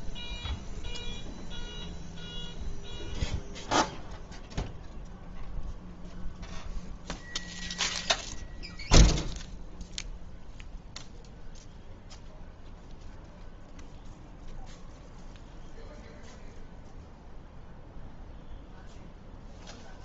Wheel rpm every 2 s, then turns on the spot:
0, 0, 0, 0, 0, 0, 0, 0, 0, 0.
none